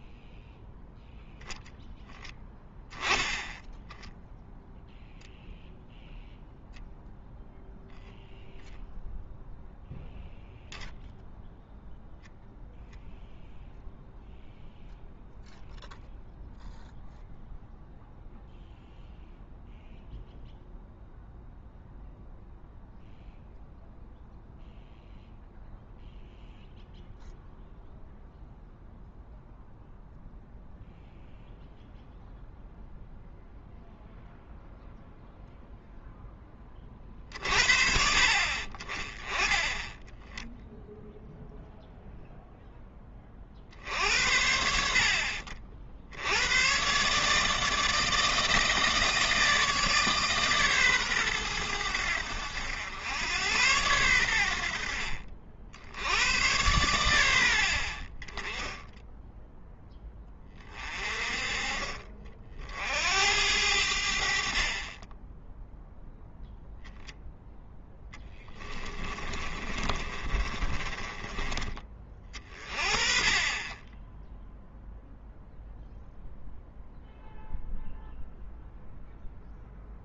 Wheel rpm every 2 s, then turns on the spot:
10, 10, 0, 0, 0, 0, 0, 0, 0, 0, 0, 0, 0, 0, 0, 0, 0, 0, 20, 40, 0, 10, 80, 110, 160, 140, 90, 70, 100, 10, 30, 50, 40, 0, 10, 30, 30, 0, 0, 0.
68-72